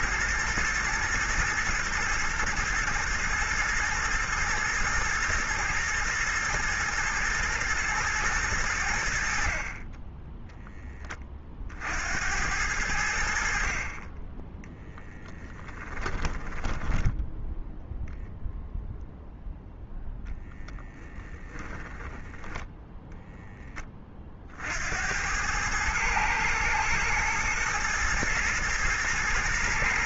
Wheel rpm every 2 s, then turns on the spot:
120, 120, 110, 110, 90, 20, 80, 10, 10, 0, 10, 10, 70, 110, 110.
14-18